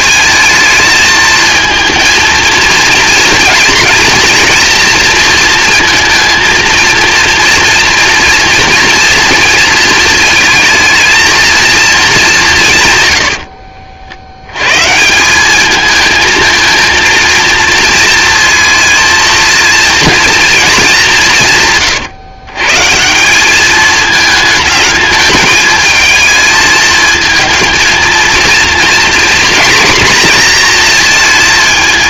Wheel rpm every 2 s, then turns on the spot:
220, 230, 240, 230, 230, 220, 160, 110, 230, 230, 220, 140, 220, 220, 230, 230.
none